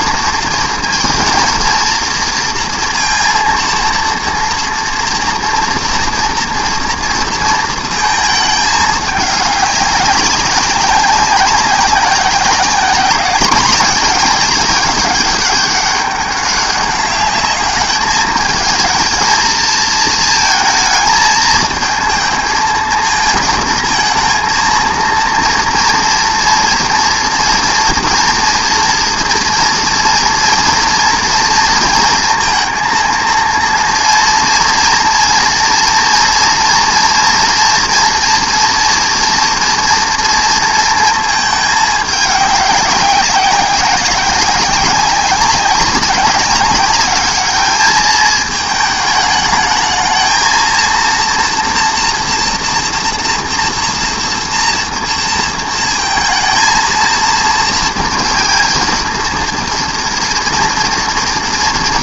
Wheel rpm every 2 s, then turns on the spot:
230, 230, 240, 230, 210, 190, 190, 210, 200, 220, 220, 220, 230, 240, 230, 230, 230, 230, 230, 230, 230, 200, 190, 200, 210, 230, 240, 240, 220, 230, 230.
none